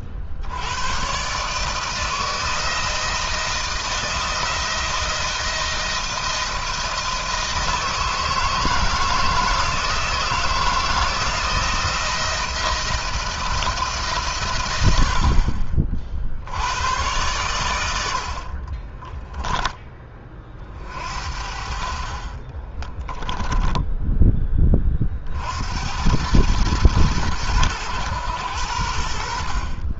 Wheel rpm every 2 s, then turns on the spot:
100, 160, 170, 160, 160, 170, 170, 80, 100, 30, 50, 20, 30, 100, 80.
18-20 22-24